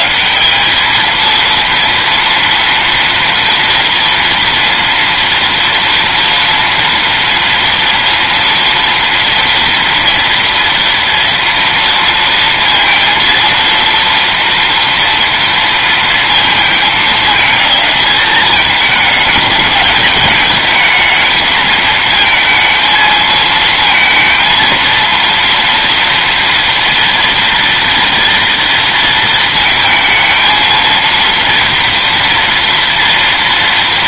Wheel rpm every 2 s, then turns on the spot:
200, 230, 240, 230, 230, 230, 230, 230, 220, 210, 220, 220, 230, 230, 230, 230, 240.
none